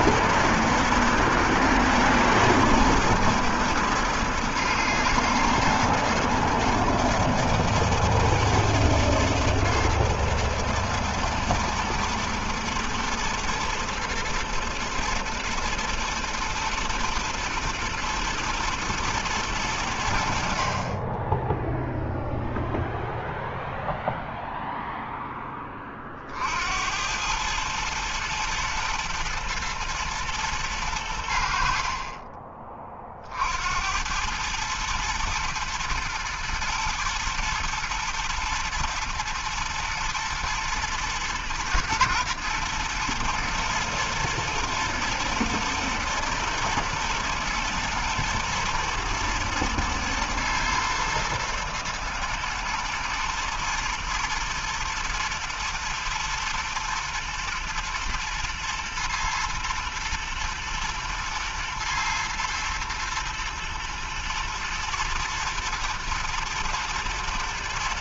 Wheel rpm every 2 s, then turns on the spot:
120, 110, 120, 110, 110, 120, 110, 110, 120, 110, 20, 0, 0, 100, 120, 90, 40, 110, 120, 110, 110, 110, 120, 110, 110, 120, 110, 120, 120, 120, 110, 110, 110, 110.
none